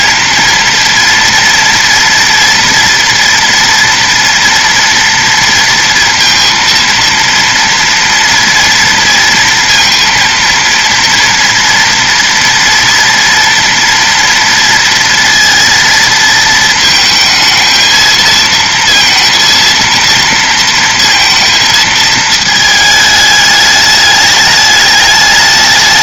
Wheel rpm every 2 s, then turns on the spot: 230, 230, 230, 230, 230, 230, 230, 230, 220, 230, 230, 220, 210.
none